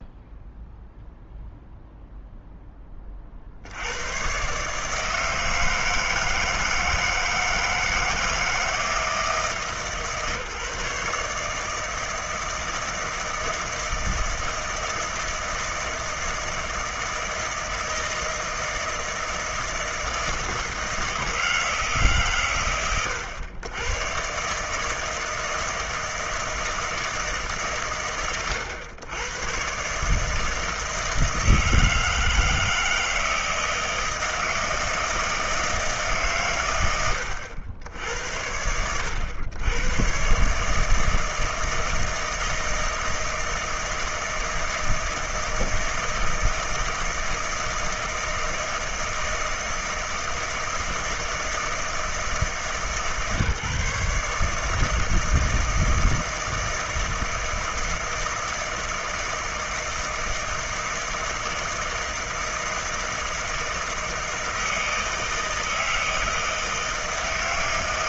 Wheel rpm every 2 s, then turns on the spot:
0, 10, 130, 160, 170, 150, 160, 160, 160, 160, 160, 120, 140, 160, 100, 160, 160, 170, 90, 70, 150, 160, 160, 160, 160, 160, 150, 150, 160, 160, 160, 160, 160, 160.
none